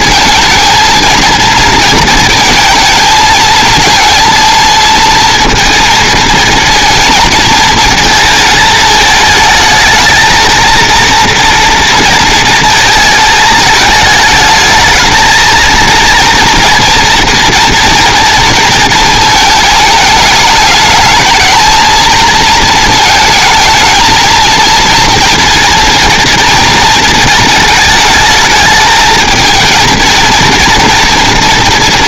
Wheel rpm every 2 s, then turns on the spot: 220, 230, 230, 230, 220, 230, 230, 220, 240, 230, 220, 230, 230, 220, 220, 230.
none